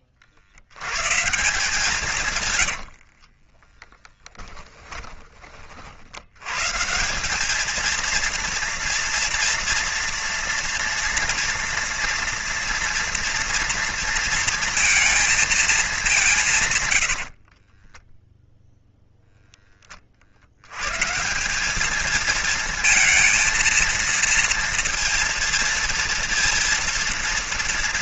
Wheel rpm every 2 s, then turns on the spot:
80, 100, 20, 150, 230, 230, 230, 230, 120, 0, 100, 220, 230, 230.
2-6